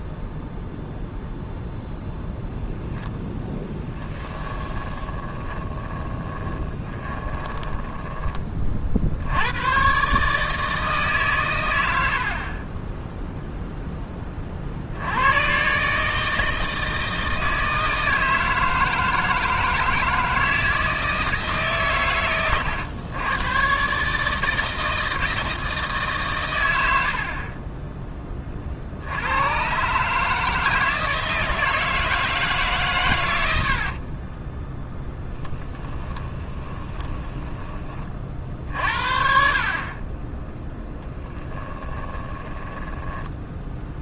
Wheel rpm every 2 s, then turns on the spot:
0, 0, 20, 20, 40, 150, 20, 60, 160, 160, 160, 110, 160, 90, 50, 160, 140, 0, 20, 60, 10, 10.
4-8 36-38 42-44